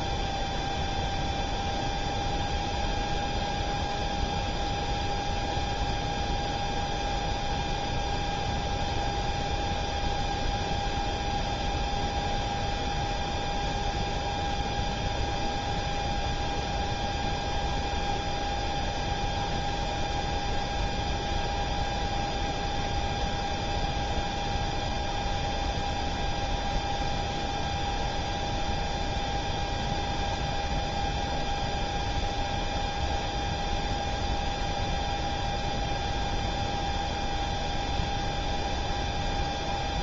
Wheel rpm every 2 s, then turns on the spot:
0, 0, 0, 0, 0, 0, 0, 0, 0, 0, 0, 0, 0, 0, 0, 0, 0, 0, 0, 0.
none